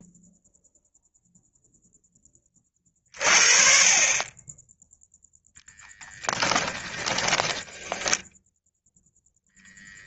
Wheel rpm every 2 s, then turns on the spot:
0, 40, 10, 10, 10.
6-8